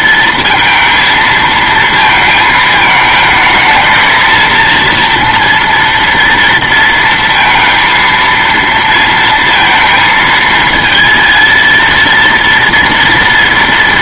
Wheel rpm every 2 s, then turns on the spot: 230, 220, 230, 230, 230, 220, 230.
none